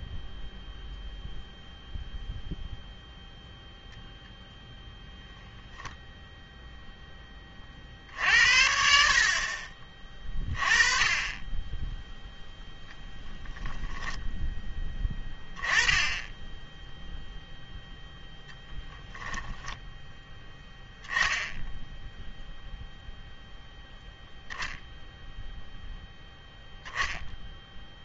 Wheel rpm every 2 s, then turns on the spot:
0, 0, 0, 0, 60, 20, 10, 10, 10, 0, 10, 0, 0, 0.
none